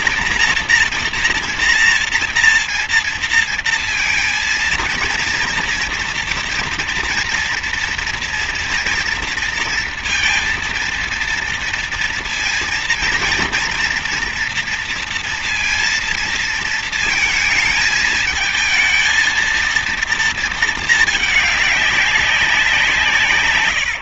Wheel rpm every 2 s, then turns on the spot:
230, 230, 230, 230, 230, 230, 230, 230, 230, 220, 220, 180.
none